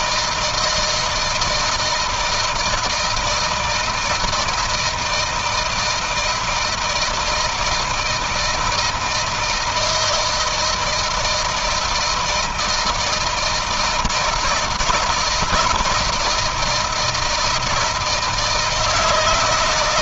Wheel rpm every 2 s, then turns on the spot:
160, 160, 160, 160, 170, 160, 160, 160, 160, 160.
none